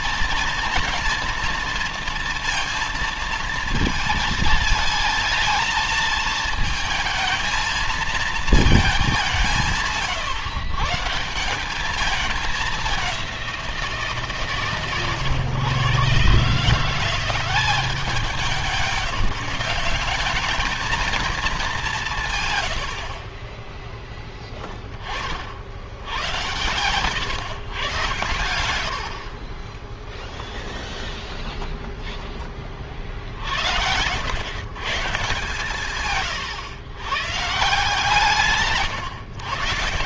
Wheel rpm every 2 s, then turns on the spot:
230, 230, 220, 220, 220, 130, 200, 140, 160, 180, 210, 90, 10, 110, 90, 0, 30, 130, 100, 150.
none